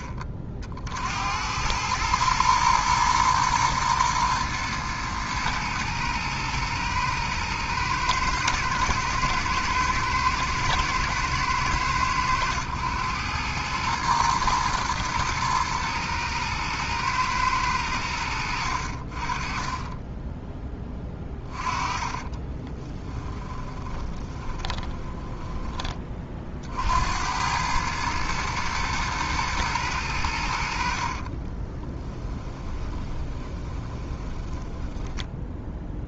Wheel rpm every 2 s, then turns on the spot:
50, 110, 110, 110, 110, 110, 110, 110, 110, 60, 10, 20, 10, 60, 110, 70, 10, 10.
18-26 32-36